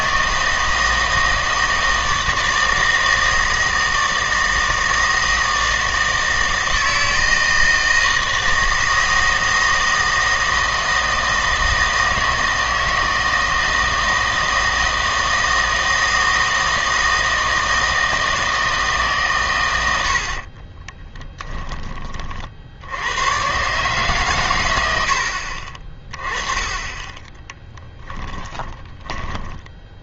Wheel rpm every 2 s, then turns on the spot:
160, 160, 160, 160, 160, 160, 160, 160, 160, 160, 30, 70, 110, 20, 10.
20-22 26-30